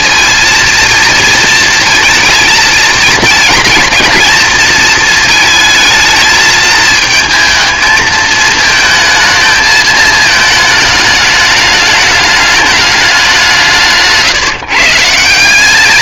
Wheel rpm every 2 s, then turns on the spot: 230, 220, 220, 220, 220, 210, 210, 140.
none